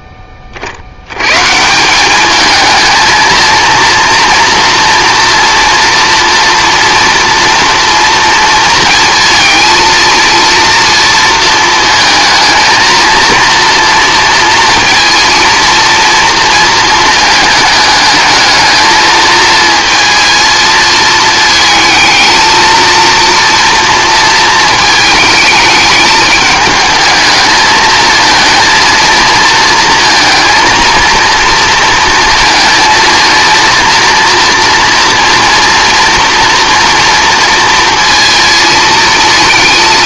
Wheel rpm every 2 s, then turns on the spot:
40, 220, 240, 230, 230, 230, 220, 230, 230, 220, 220, 230, 220, 210, 230, 230, 220, 230, 230, 220.
none